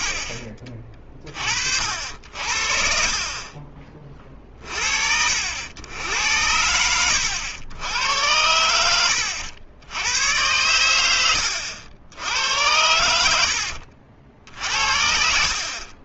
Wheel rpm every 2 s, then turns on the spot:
30, 30, 50, 80, 90, 70, 60, 70.
none